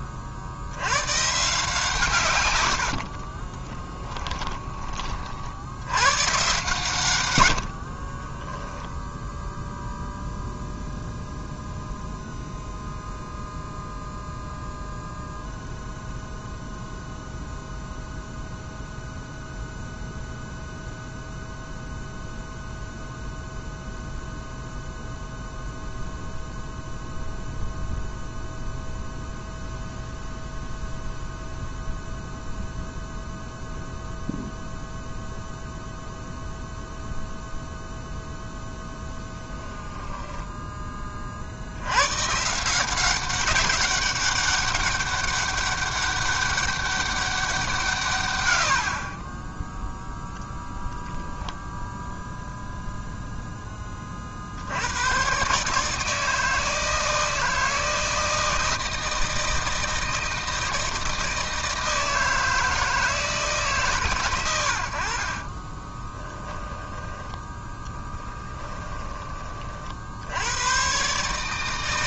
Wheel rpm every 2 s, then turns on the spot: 80, 90, 30, 130, 0, 0, 0, 0, 0, 0, 0, 0, 0, 0, 0, 0, 0, 0, 0, 0, 10, 170, 200, 200, 90, 10, 0, 80, 160, 160, 160, 160, 80, 10, 20, 120.
2-4 48-50 66-68